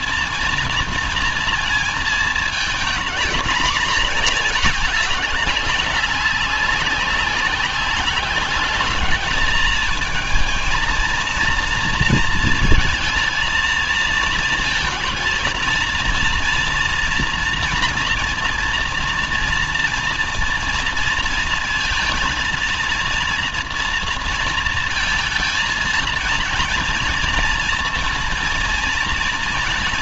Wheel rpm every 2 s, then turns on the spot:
230, 230, 200, 200, 210, 230, 220, 230, 240, 230, 230, 230, 230, 230, 230.
none